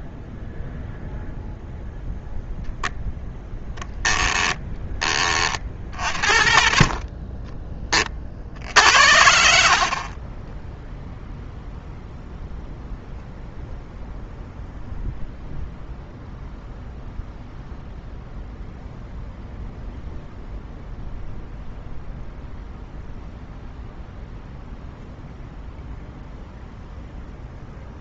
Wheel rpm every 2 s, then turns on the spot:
0, 0, 20, 50, 60, 0, 0, 0, 0, 0, 0, 0, 0, 0.
none